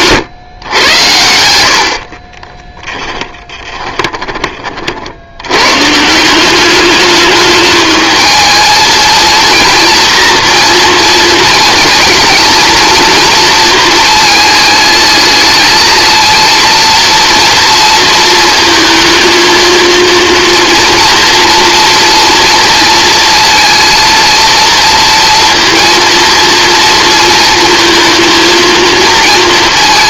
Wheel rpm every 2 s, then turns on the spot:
120, 20, 40, 200, 220, 230, 220, 220, 230, 220, 230, 230, 230, 230, 230.
2-4